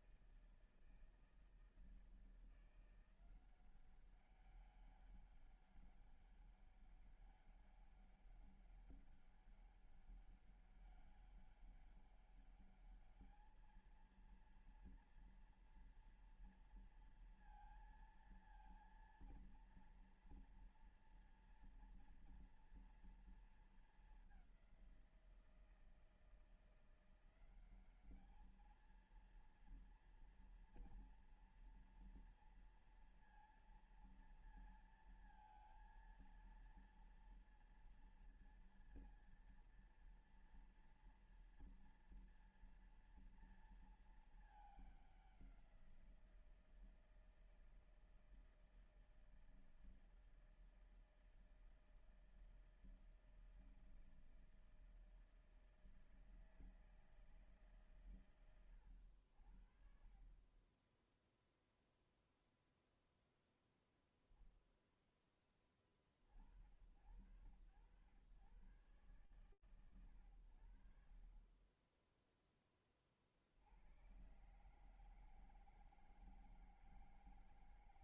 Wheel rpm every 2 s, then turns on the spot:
160, 180, 200, 200, 200, 200, 210, 230, 230, 230, 230, 230, 180, 170, 220, 230, 230, 230, 230, 230, 230, 230, 200, 160, 160, 160, 160, 160, 160, 100, 10, 0, 10, 100, 130, 50, 30, 150, 160.
none